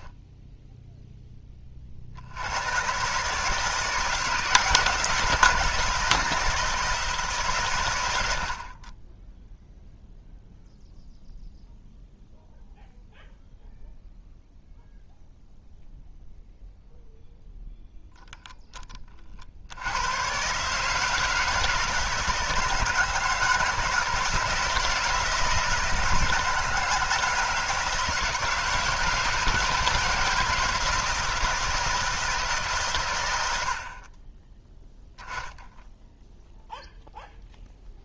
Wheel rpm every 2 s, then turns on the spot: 0, 120, 160, 160, 30, 0, 0, 0, 0, 10, 150, 160, 170, 160, 170, 160, 140, 10, 0.
none